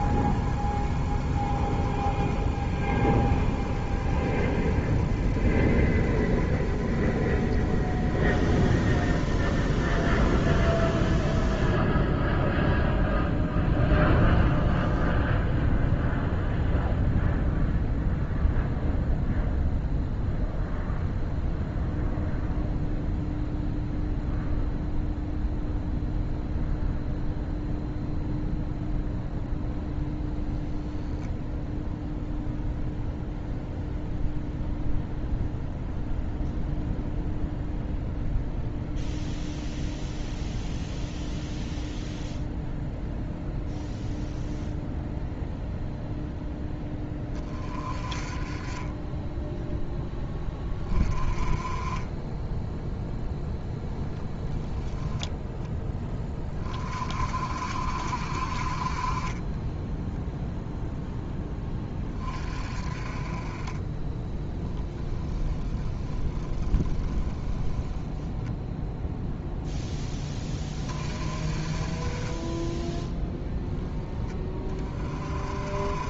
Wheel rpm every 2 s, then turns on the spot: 20, 20, 20, 20, 20, 20, 0, 0, 0, 0, 0, 0, 0, 0, 0, 0, 0, 0, 0, 0, 0, 0, 0, 10, 20, 20, 0, 10, 20, 30, 0, 30, 20, 10, 0, 20, 10, 20.
64-68 72-74